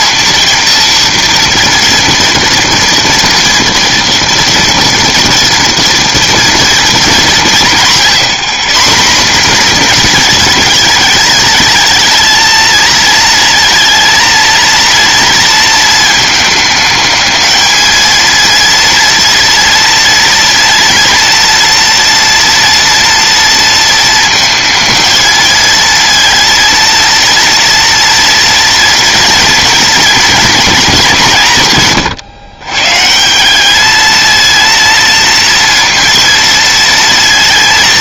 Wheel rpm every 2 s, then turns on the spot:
230, 230, 230, 220, 170, 210, 220, 230, 220, 240, 230, 230, 220, 230, 240, 210, 140, 230, 230.
none